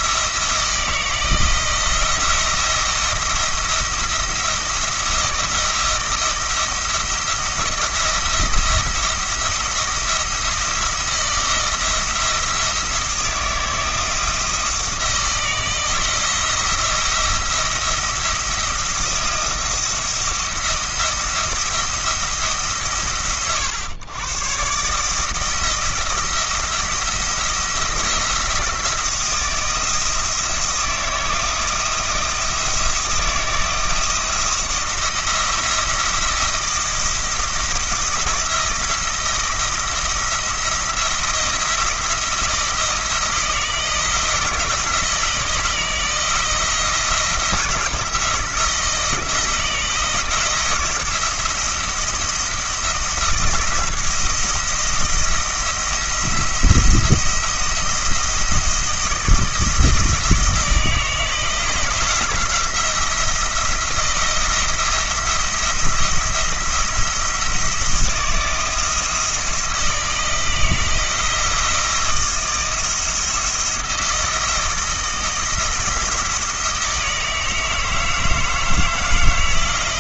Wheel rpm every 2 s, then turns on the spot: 170, 170, 170, 170, 170, 170, 170, 170, 170, 170, 170, 150, 140, 170, 170, 170, 160, 170, 170, 170, 170, 160, 160, 160, 170, 170, 170, 170, 170, 160, 160, 170, 160, 170, 170, 170, 170, 170, 160, 160.
none